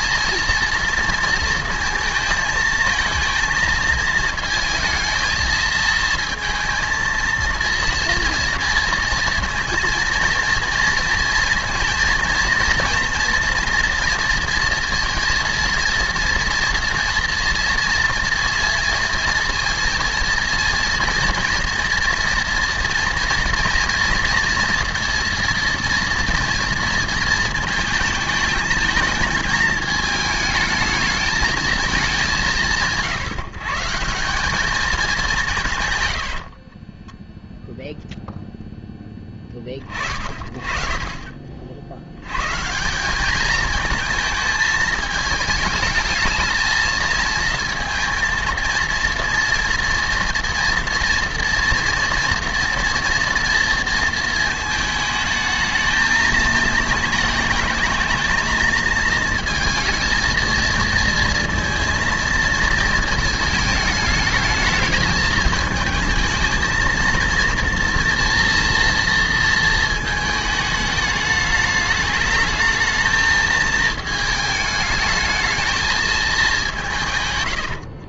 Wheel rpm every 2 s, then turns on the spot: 230, 220, 220, 230, 230, 230, 230, 230, 230, 230, 230, 230, 230, 230, 220, 220, 150, 200, 20, 0, 30, 150, 220, 220, 230, 230, 230, 220, 220, 230, 230, 220, 220, 220, 230, 210, 220, 220, 180.
36-38